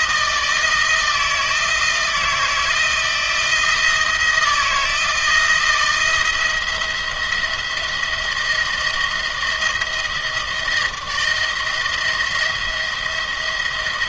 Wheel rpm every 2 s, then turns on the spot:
160, 160, 160, 170, 170, 160, 170.
none